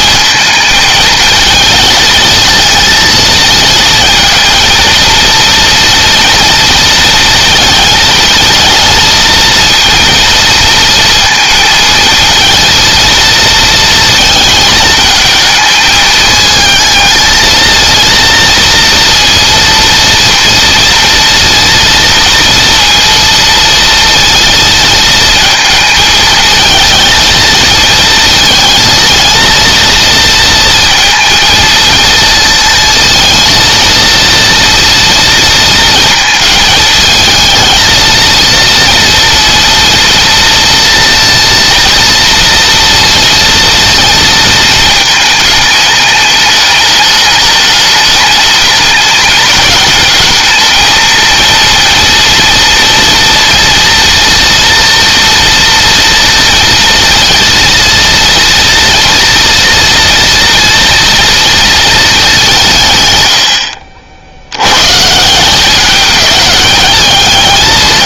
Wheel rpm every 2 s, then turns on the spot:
220, 230, 230, 230, 230, 230, 230, 220, 220, 230, 240, 230, 220, 220, 230, 230, 230, 230, 220, 230, 230, 230, 220, 210, 210, 220, 230, 230, 230, 230, 230, 160, 110, 210.
none